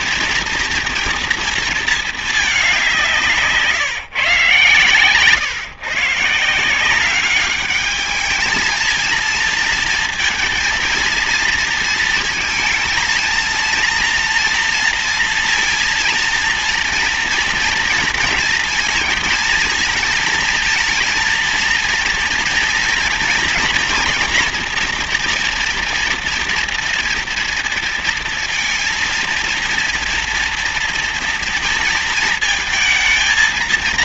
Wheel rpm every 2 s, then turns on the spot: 230, 190, 130, 170, 220, 230, 220, 230, 230, 230, 230, 230, 230, 240, 230, 230, 220.
none